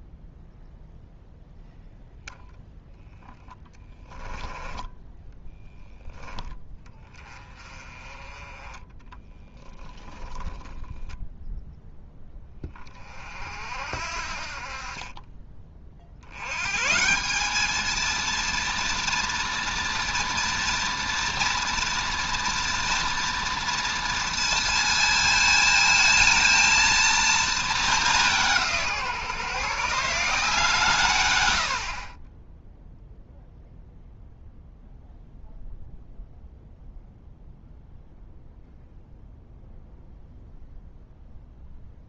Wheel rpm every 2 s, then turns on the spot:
0, 0, 10, 10, 10, 0, 20, 50, 130, 230, 230, 240, 230, 230, 170, 160, 0, 0, 0, 0, 0.
8-10